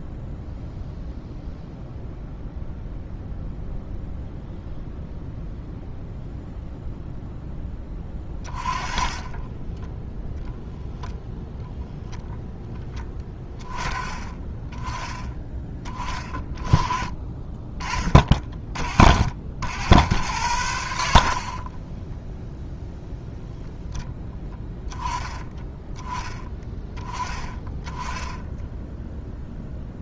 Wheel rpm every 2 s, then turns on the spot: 0, 0, 0, 0, 30, 0, 10, 10, 20, 50, 90, 0, 10, 20, 0.
8-10